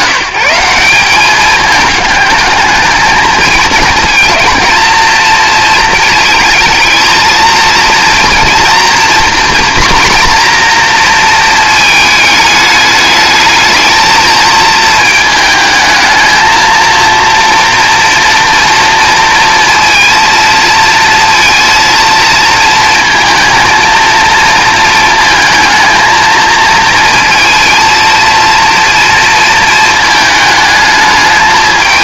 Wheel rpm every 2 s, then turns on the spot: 190, 220, 230, 230, 240, 240, 210, 220, 230, 230, 230, 230, 230, 220, 230, 210.
none